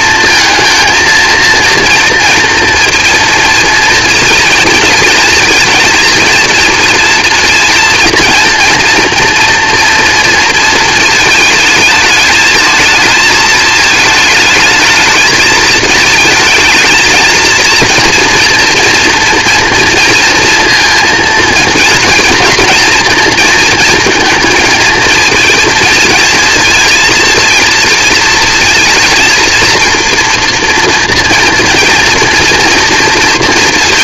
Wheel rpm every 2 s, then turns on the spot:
230, 230, 230, 230, 230, 230, 220, 220, 220, 230, 230, 230, 230, 220, 230, 230, 230.
none